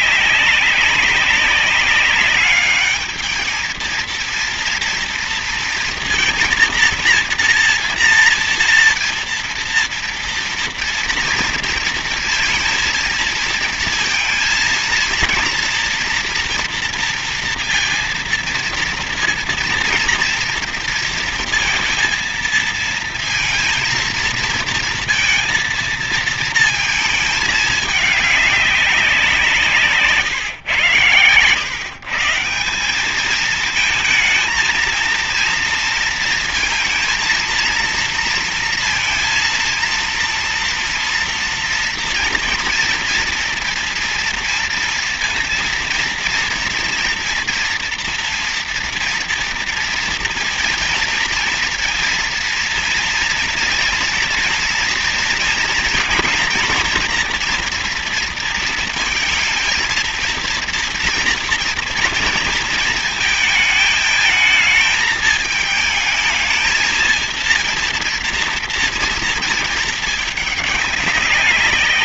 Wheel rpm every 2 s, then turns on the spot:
190, 200, 230, 230, 230, 230, 230, 230, 230, 230, 230, 230, 230, 220, 200, 140, 170, 220, 230, 230, 230, 230, 230, 230, 230, 230, 230, 230, 230, 230, 230, 230, 220, 220, 230, 210.
none